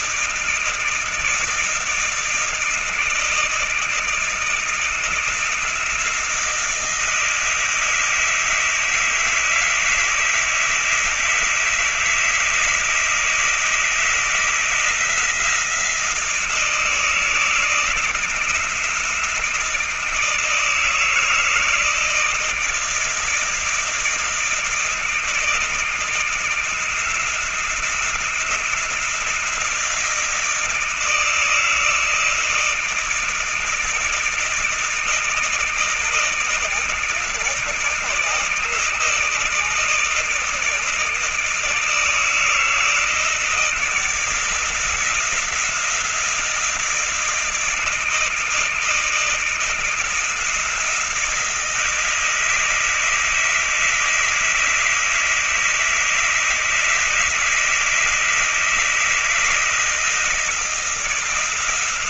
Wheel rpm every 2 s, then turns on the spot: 160, 160, 160, 160, 160, 160, 160, 160, 160, 160, 160, 160, 160, 170, 170, 160, 160, 160, 160, 160, 160, 160, 170, 160, 160, 160, 160, 160, 160, 160, 160.
none